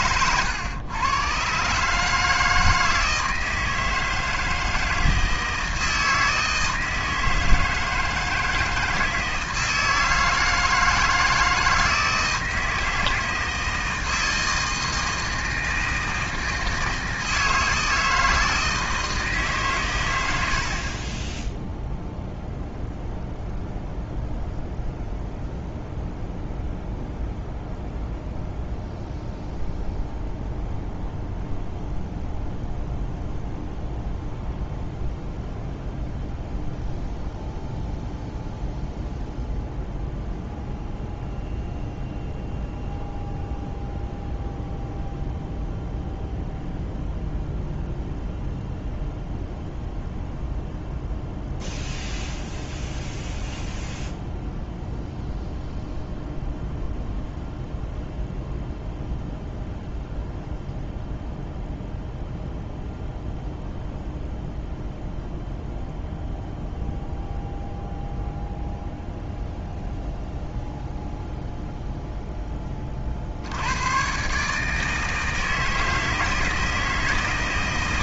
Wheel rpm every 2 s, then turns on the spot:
110, 160, 160, 160, 160, 160, 160, 160, 160, 160, 40, 0, 0, 0, 0, 0, 0, 0, 0, 0, 0, 0, 0, 0, 0, 0, 0, 0, 0, 0, 0, 0, 0, 0, 0, 0, 40, 160, 160.
none